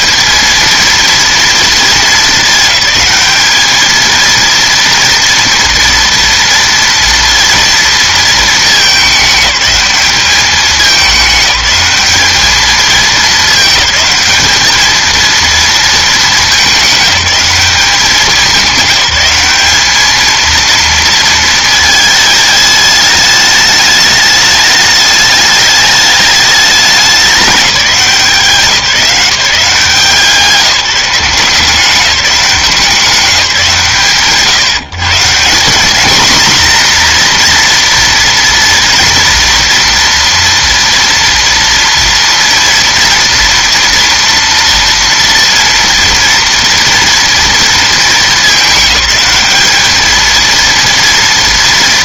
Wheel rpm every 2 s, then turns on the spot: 220, 210, 230, 230, 220, 210, 210, 210, 210, 190, 220, 220, 210, 210, 190, 170, 180, 150, 230, 230, 230, 230, 230, 230, 210, 230.
none